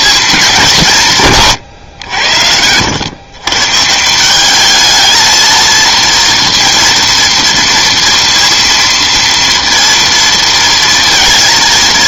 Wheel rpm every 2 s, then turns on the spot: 210, 80, 200, 230, 230, 230.
none